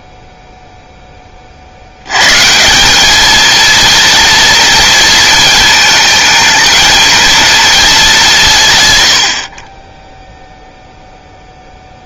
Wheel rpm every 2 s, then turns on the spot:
0, 170, 230, 230, 150, 0.
none